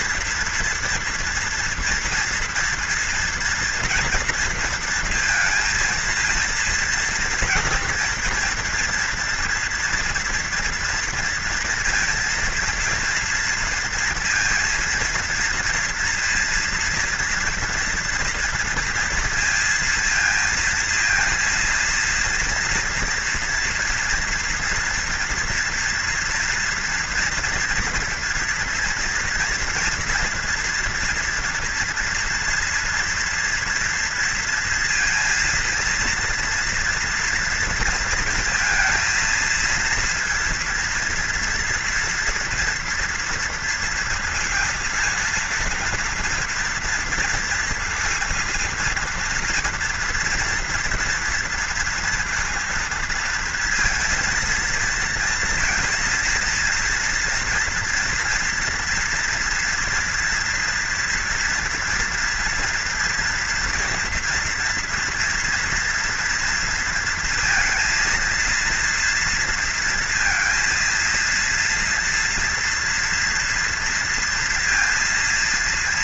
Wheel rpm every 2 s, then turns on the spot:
230, 230, 230, 230, 240, 230, 230, 230, 230, 240, 230, 230, 240, 240, 240, 230, 230, 230, 230, 230, 230, 230, 230, 240, 230, 230, 230, 230, 230, 230, 230, 230, 230, 230, 230, 230, 230, 230.
none